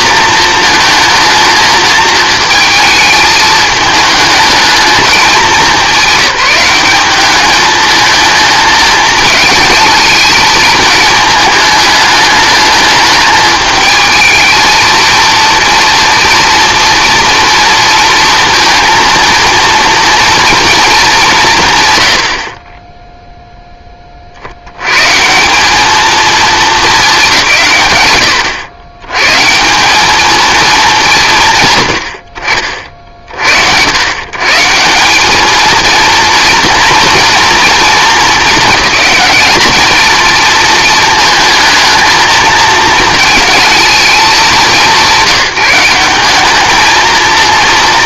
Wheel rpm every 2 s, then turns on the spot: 230, 220, 210, 190, 220, 220, 210, 230, 240, 230, 230, 10, 130, 200, 90, 190, 50, 170, 230, 220, 220, 220, 160, 220.
none